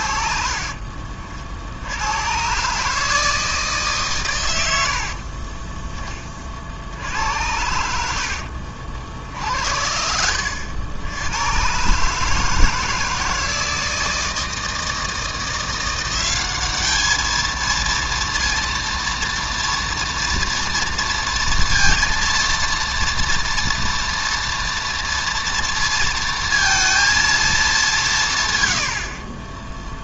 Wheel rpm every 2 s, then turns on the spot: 50, 140, 70, 70, 60, 80, 160, 160, 210, 230, 230, 230, 230, 230, 90.
0-2 4-6